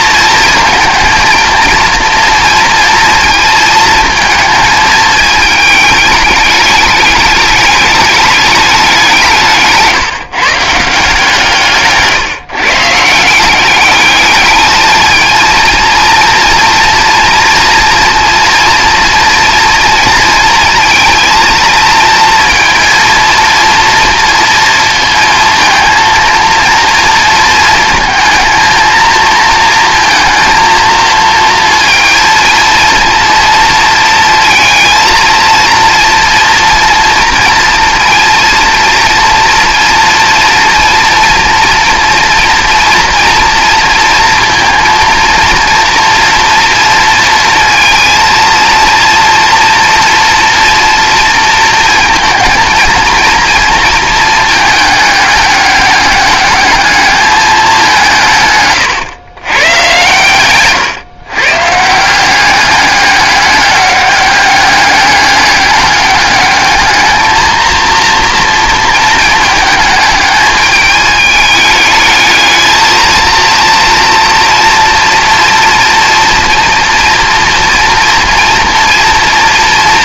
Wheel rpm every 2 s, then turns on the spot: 230, 230, 220, 210, 200, 160, 150, 210, 230, 230, 230, 230, 230, 230, 220, 230, 230, 230, 230, 230, 230, 230, 230, 230, 230, 230, 230, 210, 210, 130, 120, 200, 200, 210, 230, 210, 220, 230, 230, 230.
none